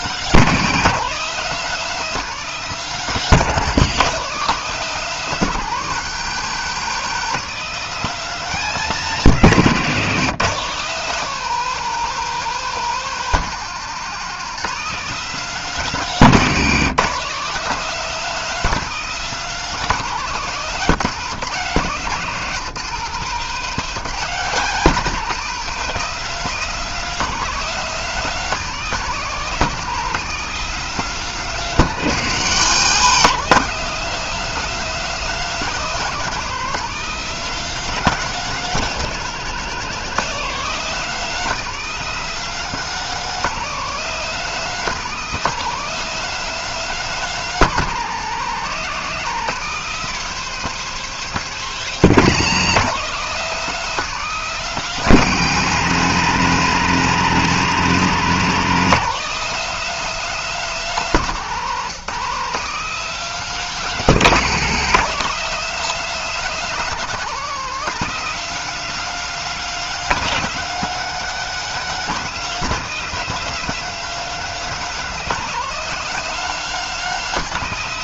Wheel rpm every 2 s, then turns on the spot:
190, 200, 190, 160, 190, 180, 200, 190, 180, 200, 180, 180, 180, 200, 180, 190, 170, 200, 200, 200, 200, 210, 190, 200, 180, 210, 190, 190, 170, 190, 190, 180, 190, 200, 200, 210, 210, 210, 200.
none